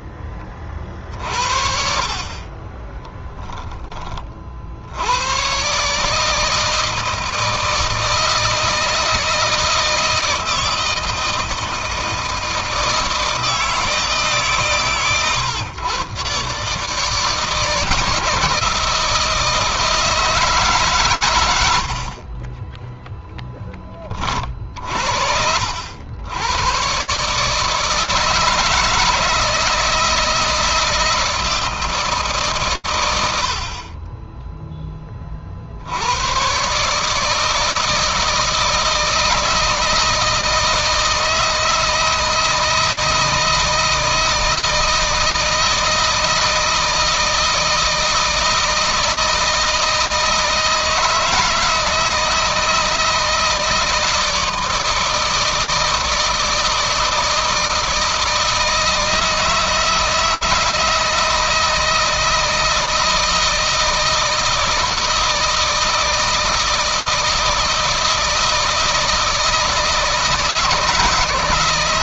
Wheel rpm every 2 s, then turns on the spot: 20, 40, 40, 150, 160, 160, 160, 150, 130, 160, 160, 40, 30, 90, 160, 160, 150, 20, 110, 160, 160, 160, 170, 160, 160, 160, 160, 160, 160, 160, 160, 160, 160, 160, 160, 160.
2-4 22-24